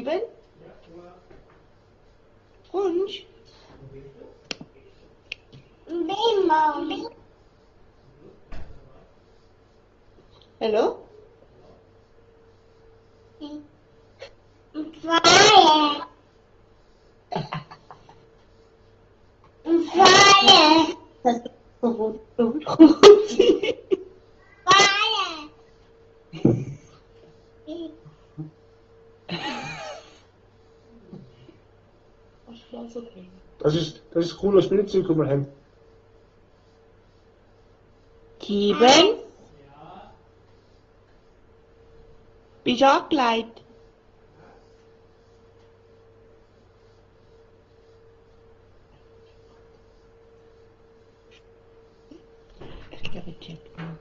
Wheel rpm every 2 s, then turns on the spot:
0, 0, 0, 0, 0, 0, 0, 0, 0, 0, 0, 0, 0, 0, 0, 0, 0, 0, 0, 0, 0, 0, 0, 0, 0, 0, 0.
none